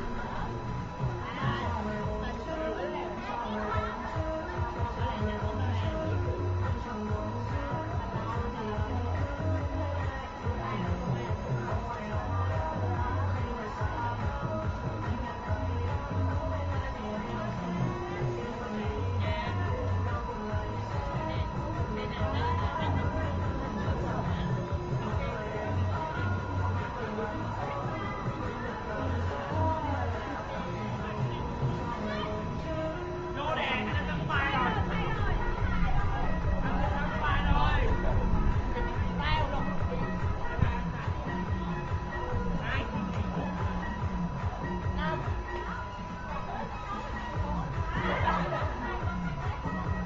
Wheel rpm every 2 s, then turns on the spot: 0, 0, 0, 0, 0, 0, 0, 0, 0, 0, 0, 0, 0, 0, 0, 0, 0, 0, 0, 0, 0, 0, 0, 0, 0.
none